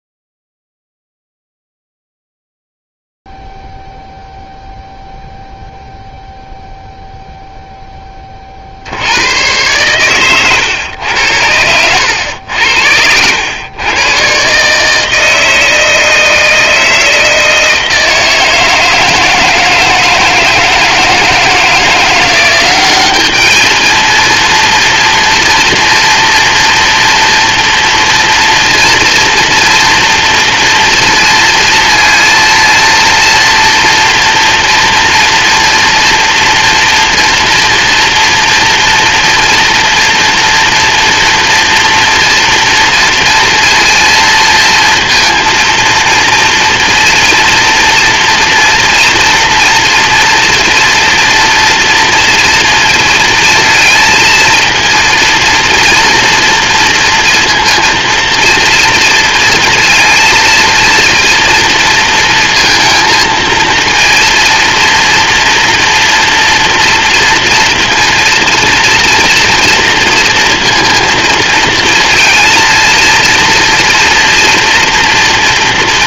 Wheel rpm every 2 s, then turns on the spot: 0, 0, 0, 0, 80, 110, 90, 150, 160, 160, 160, 200, 240, 230, 230, 230, 230, 230, 230, 230, 230, 230, 230, 230, 240, 240, 230, 230, 240, 230, 230, 230, 230, 230, 230, 230, 230, 230.
none